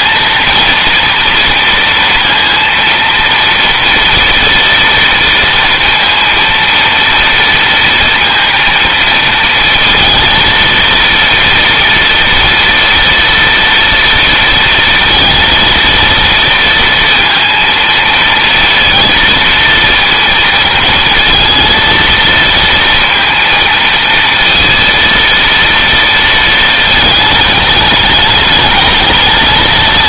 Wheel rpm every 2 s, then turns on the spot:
230, 230, 230, 230, 230, 230, 230, 230, 230, 230, 230, 230, 230, 220, 220.
none